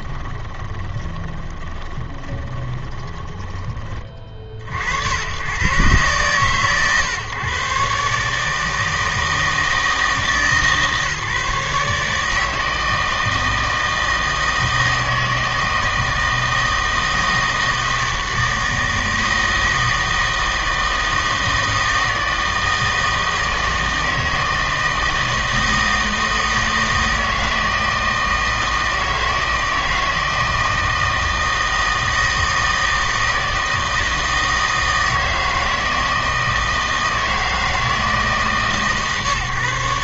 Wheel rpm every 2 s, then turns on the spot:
20, 20, 40, 130, 150, 160, 160, 160, 160, 160, 160, 160, 160, 160, 160, 160, 160, 160, 160, 160.
0-4